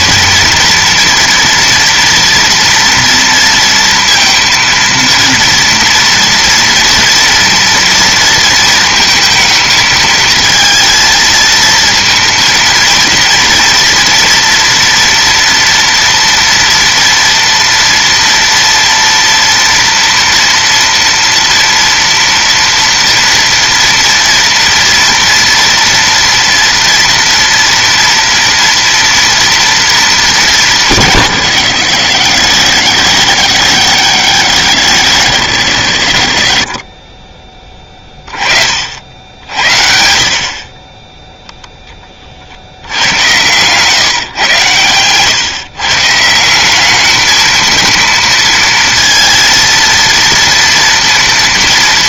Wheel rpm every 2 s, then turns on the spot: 230, 230, 230, 230, 230, 230, 230, 240, 230, 230, 230, 240, 230, 230, 230, 180, 90, 90, 30, 40, 30, 70, 120, 190, 230, 230.
none